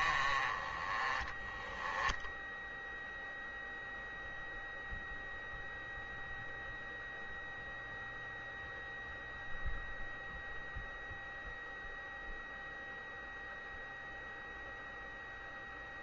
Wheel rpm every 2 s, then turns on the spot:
30, 10, 0, 0, 0, 0, 0, 0.
none